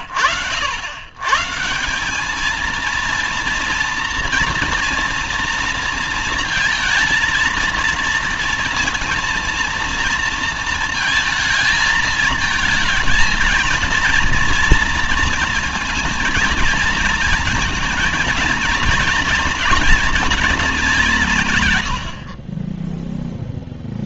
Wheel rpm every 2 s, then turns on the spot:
110, 230, 230, 230, 230, 220, 220, 230, 220, 230, 180, 0.
none